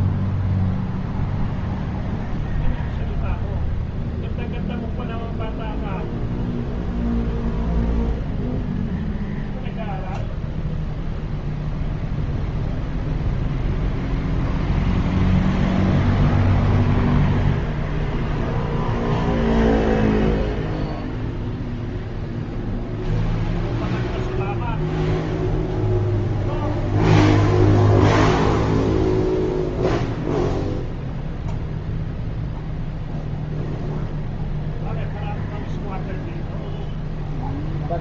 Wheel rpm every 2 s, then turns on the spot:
0, 0, 0, 0, 0, 0, 0, 0, 0, 0, 0, 0, 0, 0, 0, 0, 0, 0, 0.
none